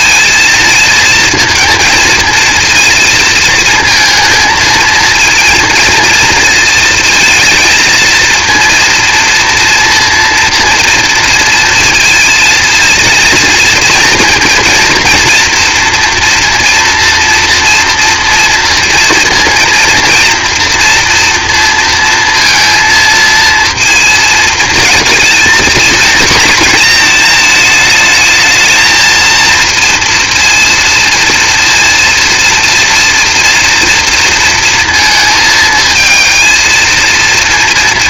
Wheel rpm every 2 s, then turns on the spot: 230, 230, 220, 230, 230, 230, 220, 240, 230, 230, 230, 230, 230, 230, 220, 230, 230, 230, 230.
none